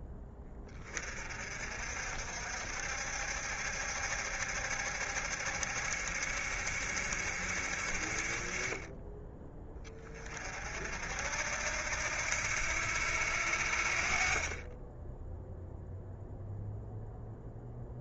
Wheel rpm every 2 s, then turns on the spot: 30, 60, 70, 70, 20, 60, 80, 20, 0.
none